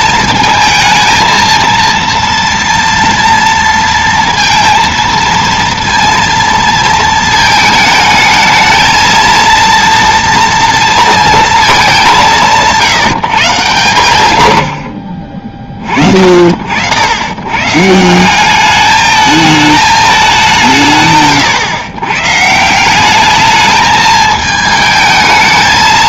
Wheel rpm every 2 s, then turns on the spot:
220, 230, 230, 230, 220, 230, 170, 80, 60, 190, 170, 150, 220.
none